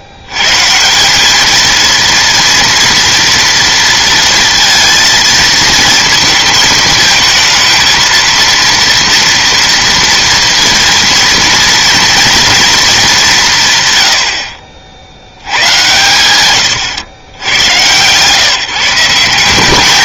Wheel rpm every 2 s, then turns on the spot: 140, 230, 230, 220, 230, 230, 240, 60, 110, 160.
none